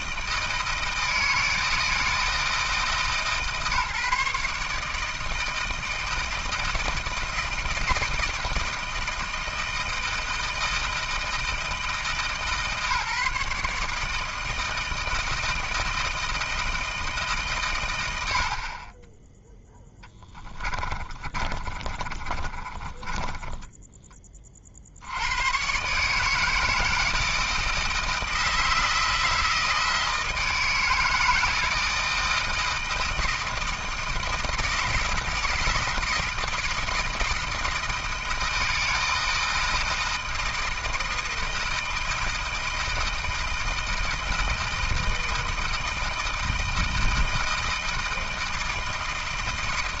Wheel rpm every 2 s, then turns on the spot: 160, 160, 150, 160, 160, 160, 150, 160, 160, 50, 20, 20, 50, 160, 160, 160, 160, 160, 160, 160, 160, 160, 160, 160, 160.
20-24